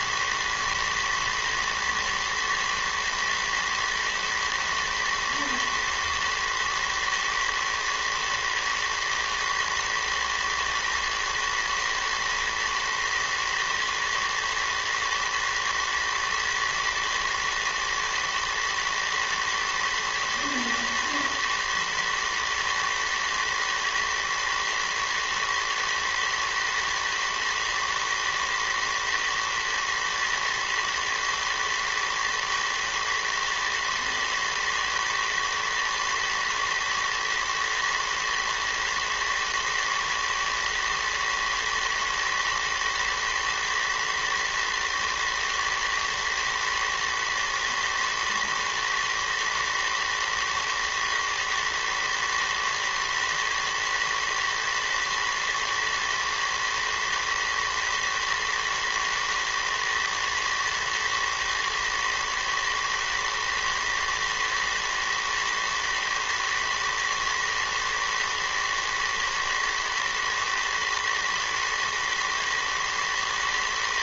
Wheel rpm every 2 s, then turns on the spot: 110, 120, 120, 110, 110, 110, 110, 110, 110, 110, 110, 110, 110, 110, 110, 110, 110, 120, 110, 110, 110, 110, 110, 110, 110, 110, 110, 110, 110, 110, 110, 110, 110, 110, 110, 110, 110.
none